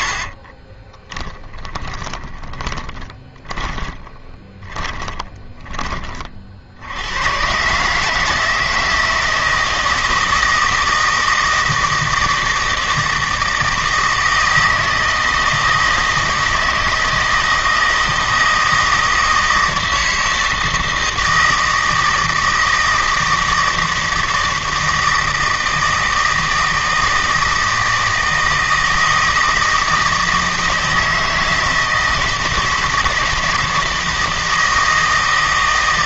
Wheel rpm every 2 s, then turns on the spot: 30, 20, 20, 70, 160, 160, 160, 160, 160, 160, 160, 160, 160, 160, 160, 160, 160, 160.
0-6